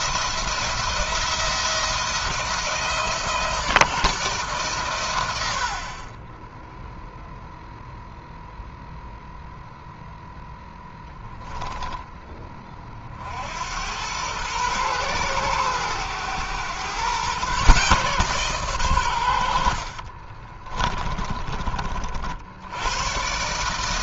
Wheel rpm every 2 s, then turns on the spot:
170, 160, 110, 0, 0, 0, 50, 120, 120, 100, 20, 120.
20-22